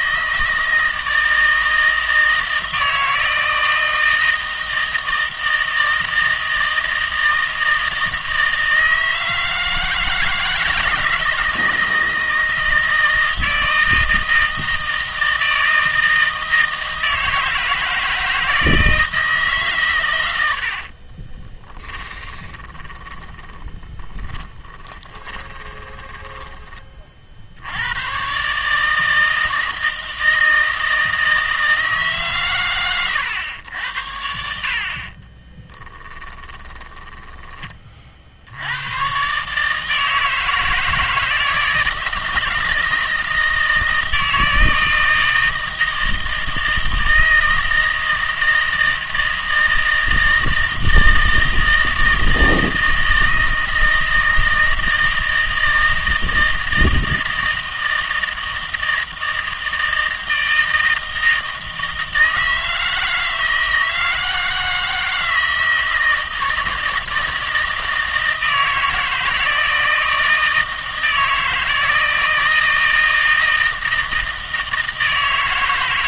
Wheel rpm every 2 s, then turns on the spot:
160, 160, 160, 160, 160, 160, 160, 160, 160, 160, 70, 20, 20, 20, 140, 160, 130, 60, 20, 80, 160, 160, 160, 160, 160, 160, 160, 160, 160, 160, 160, 160, 160, 160, 160, 160, 160, 160.
20-28 36-38